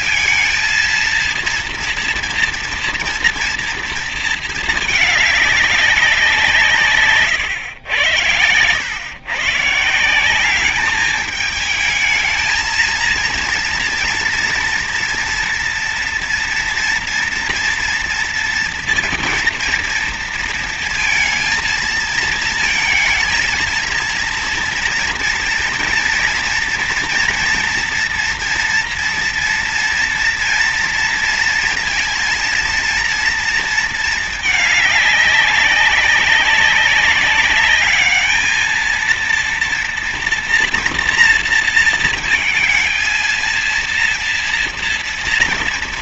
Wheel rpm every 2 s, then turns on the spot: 230, 230, 220, 160, 100, 200, 230, 240, 230, 230, 230, 230, 230, 240, 230, 230, 230, 210, 200, 220, 230, 230, 230.
6-8